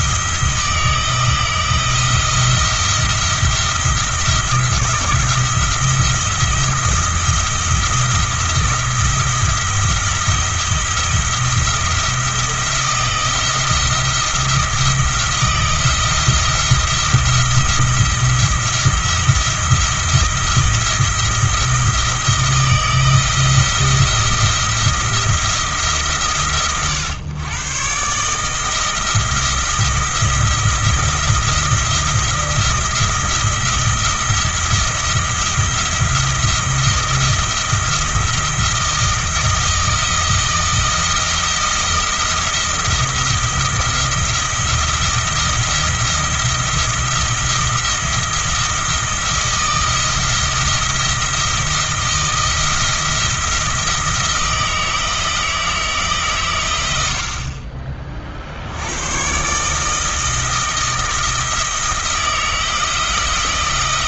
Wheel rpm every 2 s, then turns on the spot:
160, 170, 170, 170, 170, 170, 170, 170, 170, 170, 170, 160, 170, 120, 160, 170, 170, 170, 170, 170, 170, 170, 170, 170, 170, 170, 170, 160, 80, 100, 160, 170.
none